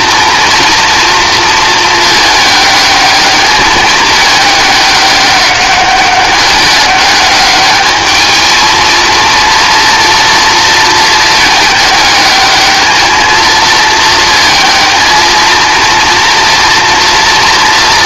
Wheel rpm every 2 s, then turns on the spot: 230, 210, 200, 200, 230, 230, 220, 230, 230.
none